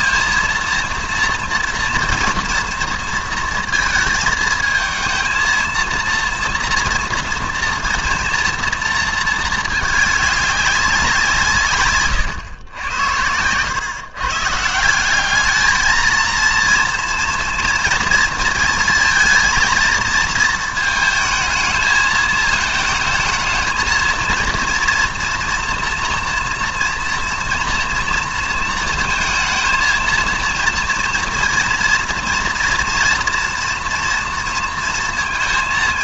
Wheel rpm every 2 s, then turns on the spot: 230, 230, 220, 230, 230, 200, 100, 150, 230, 230, 220, 220, 240, 230, 220, 230, 230, 230.
none